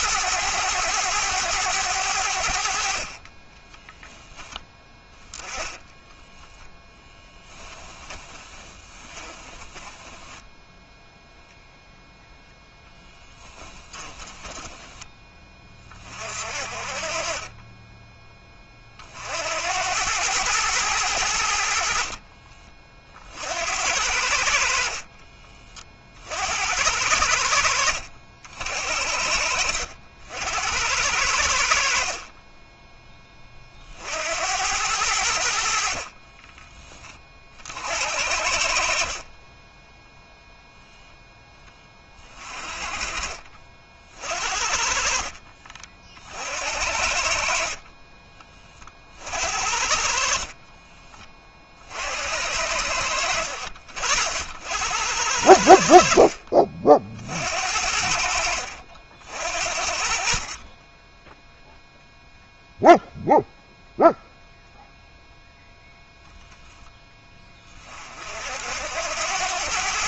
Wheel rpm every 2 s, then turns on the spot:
110, 60, 10, 0, 20, 10, 10, 20, 50, 30, 110, 30, 70, 70, 60, 80, 20, 80, 20, 70, 0, 30, 50, 60, 30, 30, 80, 70, 50, 60, 30, 0, 0, 10, 60.
8-12 14-16 42-44 50-52